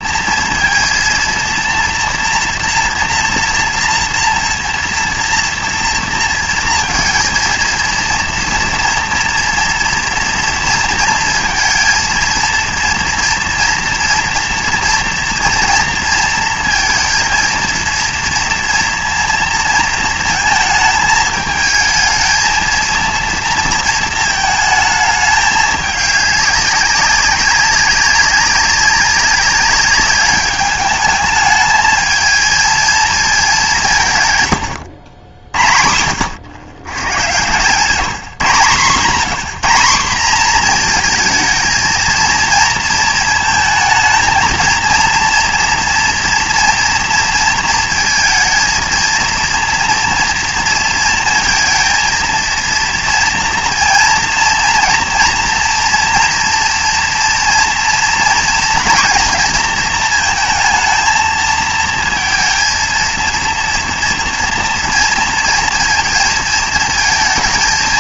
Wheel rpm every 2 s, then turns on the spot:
230, 230, 240, 230, 230, 230, 230, 230, 230, 230, 220, 230, 220, 200, 200, 210, 220, 120, 110, 160, 230, 230, 230, 230, 230, 230, 230, 230, 230, 230, 230, 230, 230, 230.
none